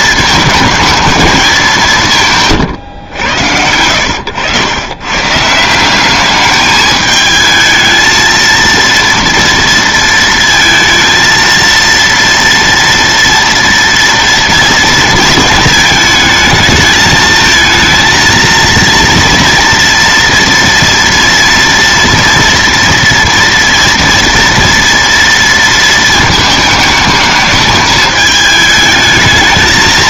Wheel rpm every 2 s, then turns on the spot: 220, 140, 100, 210, 230, 230, 230, 230, 220, 230, 230, 230, 230, 220, 210.
none